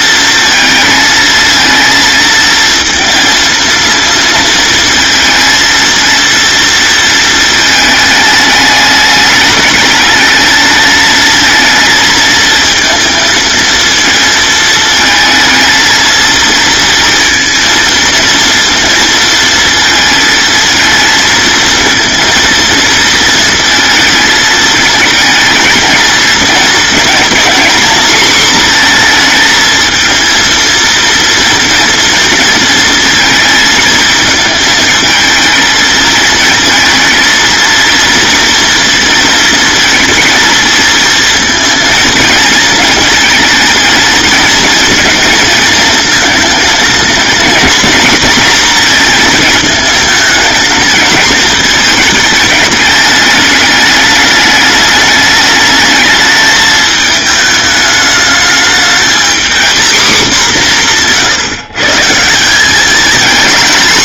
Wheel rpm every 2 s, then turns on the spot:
230, 230, 220, 230, 210, 220, 230, 220, 230, 230, 230, 230, 220, 230, 230, 230, 220, 220, 230, 230, 230, 230, 220, 230, 230, 220, 210, 210, 220, 220, 180, 220.
none